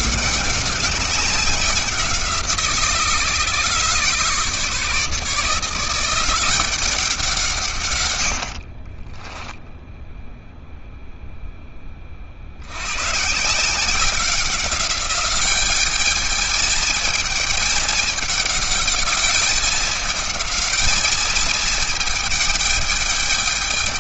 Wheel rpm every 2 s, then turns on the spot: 190, 160, 160, 180, 30, 0, 120, 200, 220, 210, 220, 210.
8-10